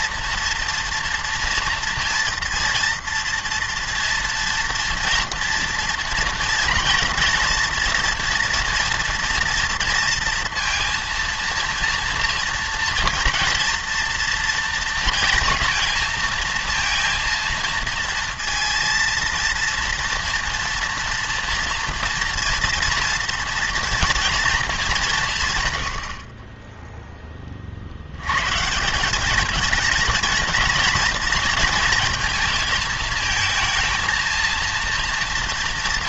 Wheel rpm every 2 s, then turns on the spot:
230, 230, 240, 230, 230, 230, 230, 230, 230, 230, 230, 230, 220, 20, 150, 230, 220, 230.
none